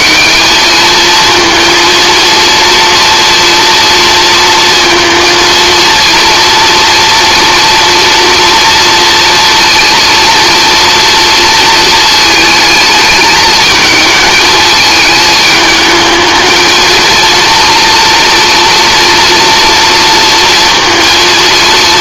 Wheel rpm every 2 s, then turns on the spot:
210, 230, 230, 230, 230, 230, 220, 220, 220, 230, 230.
none